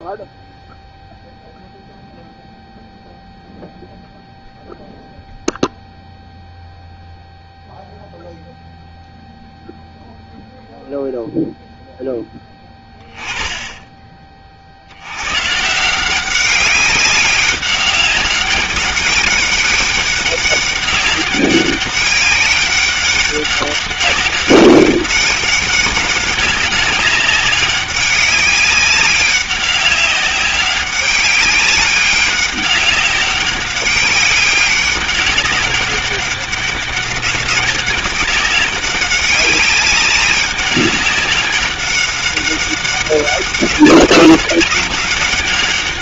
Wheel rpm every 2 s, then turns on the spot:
0, 0, 0, 0, 0, 0, 20, 50, 190, 200, 200, 200, 200, 200, 190, 190, 200, 200, 200, 200, 200, 200, 200.
none